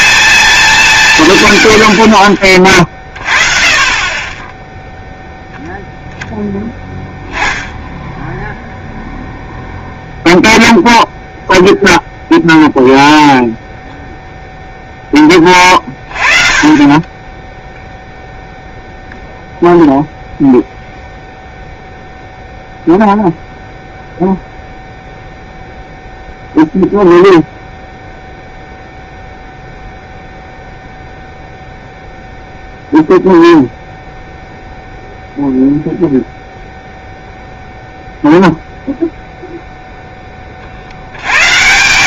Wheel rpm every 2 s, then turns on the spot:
200, 30, 10, 0, 0, 0, 0, 0, 30, 0, 0, 0, 0, 0, 0, 0, 0, 0, 0, 0, 20.
none